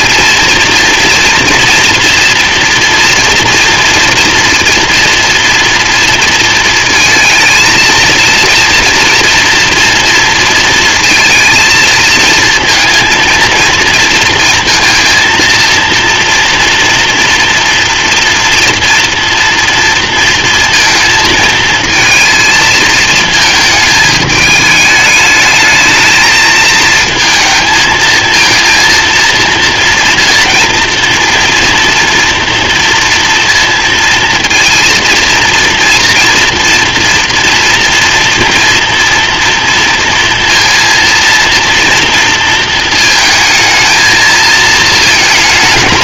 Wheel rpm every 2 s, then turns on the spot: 230, 230, 230, 230, 230, 230, 230, 230, 230, 240, 230, 220, 210, 220, 230, 230, 230, 230, 230, 230, 230, 230, 220.
none